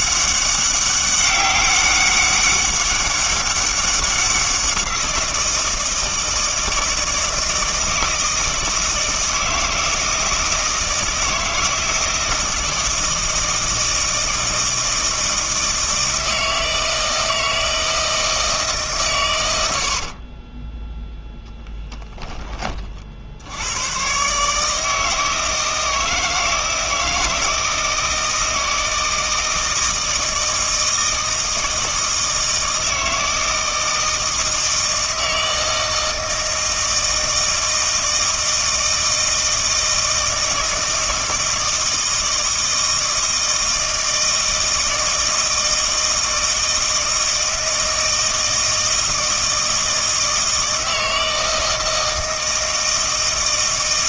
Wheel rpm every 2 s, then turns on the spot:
200, 200, 180, 160, 160, 160, 160, 160, 160, 150, 10, 30, 150, 160, 160, 160, 160, 160, 160, 160, 160, 160, 160, 160, 160, 160, 160.
20-22